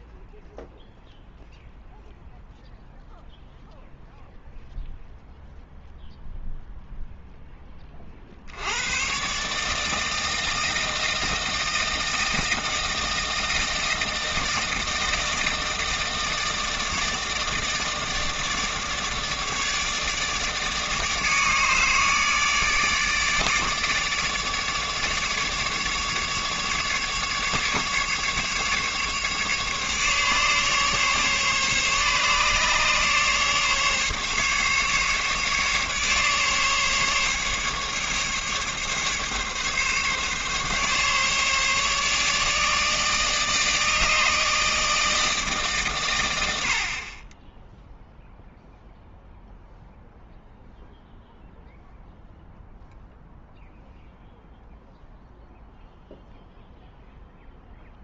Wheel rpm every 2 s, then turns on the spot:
0, 0, 0, 0, 100, 160, 160, 160, 160, 150, 150, 150, 150, 150, 150, 140, 150, 150, 140, 140, 140, 150, 160, 60, 0, 0, 0, 0, 0.
none